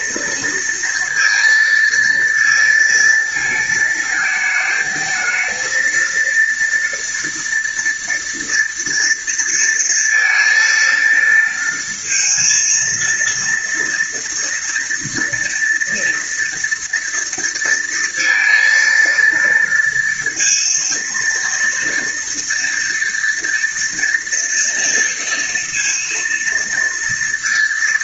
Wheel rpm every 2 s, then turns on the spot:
230, 230, 220, 230, 230, 230, 230, 230, 230, 230, 230, 230, 230, 230.
none